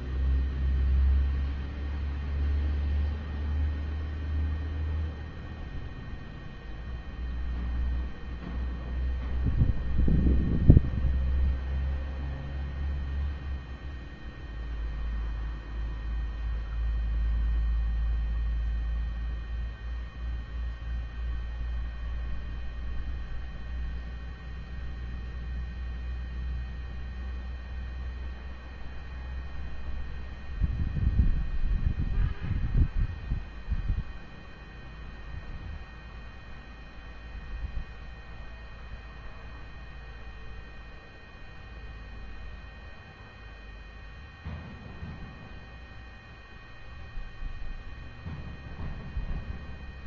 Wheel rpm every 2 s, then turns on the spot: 0, 0, 0, 0, 0, 0, 0, 0, 0, 0, 0, 0, 0, 0, 0, 0, 0, 0, 0, 0, 0, 0, 0, 0, 0.
none